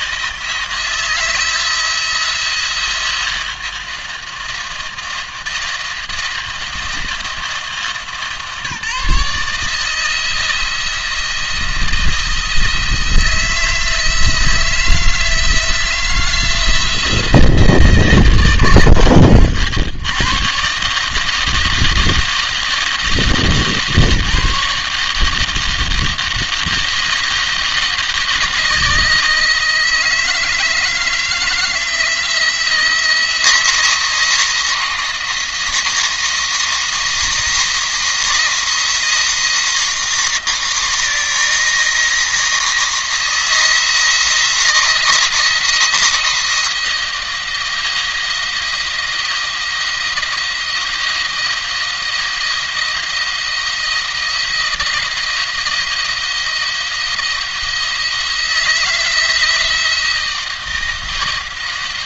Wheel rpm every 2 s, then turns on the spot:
160, 170, 170, 170, 160, 170, 160, 160, 170, 140, 140, 160, 150, 170, 160, 160, 170, 170, 170, 170, 170, 160, 170, 170, 170, 170, 170, 170, 170, 160, 160.
none